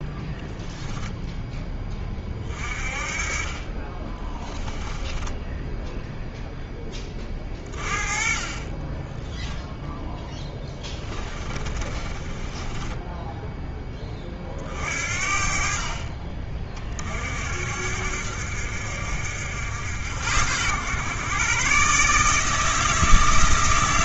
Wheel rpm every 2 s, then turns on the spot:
0, 40, 10, 10, 20, 10, 10, 40, 30, 60, 100, 160.
4-6 10-14